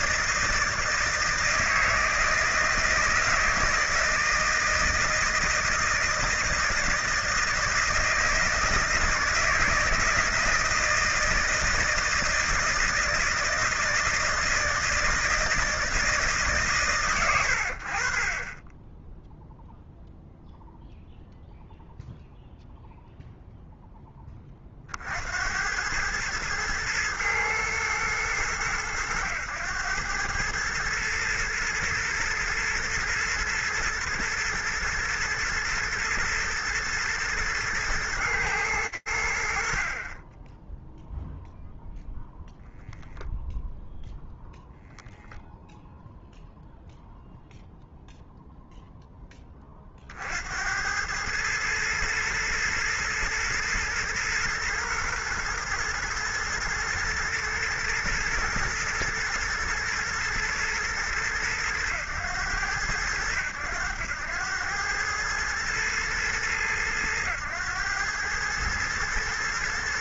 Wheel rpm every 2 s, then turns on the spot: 160, 160, 160, 160, 160, 160, 160, 160, 130, 10, 0, 0, 50, 110, 100, 110, 110, 110, 110, 100, 10, 0, 0, 0, 10, 100, 110, 110, 120, 110, 110, 100, 110, 110, 120.
none